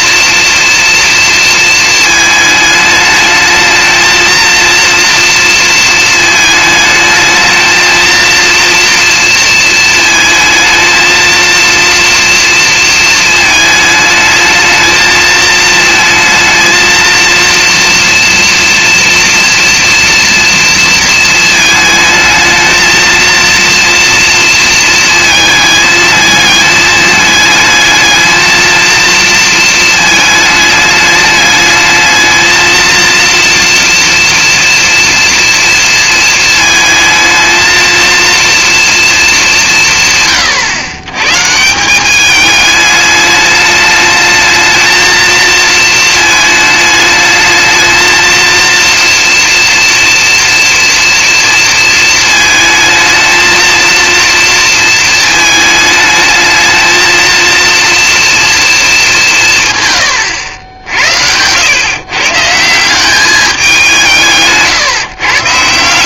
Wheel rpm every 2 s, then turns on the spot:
230, 210, 230, 220, 220, 230, 220, 220, 230, 230, 230, 230, 220, 210, 220, 210, 230, 230, 220, 200, 140, 210, 230, 220, 240, 230, 220, 220, 230, 180, 90, 200, 130.
none